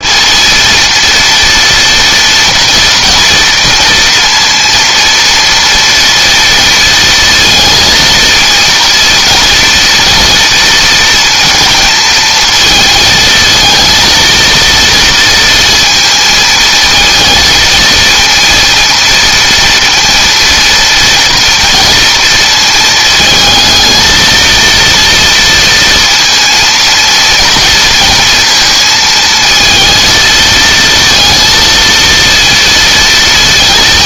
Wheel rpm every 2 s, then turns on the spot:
230, 230, 230, 230, 220, 230, 220, 230, 220, 230, 230, 230, 230, 230, 230, 220, 230.
none